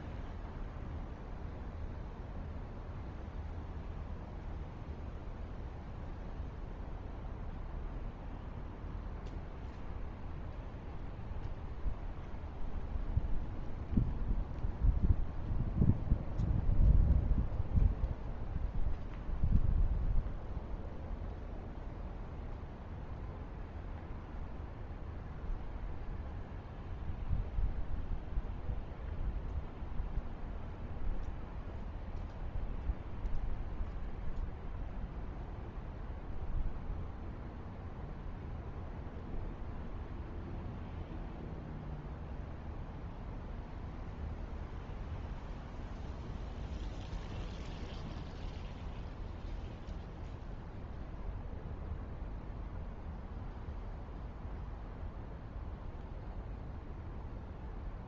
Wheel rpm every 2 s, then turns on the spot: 0, 0, 0, 0, 0, 0, 0, 0, 0, 0, 0, 0, 0, 0, 0, 0, 0, 0, 0, 0, 0, 0, 0, 0, 0, 0, 0, 0, 0.
none